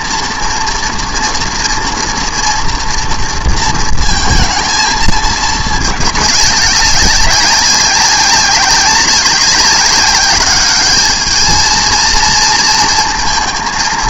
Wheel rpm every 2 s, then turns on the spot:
230, 230, 220, 200, 190, 200, 220.
none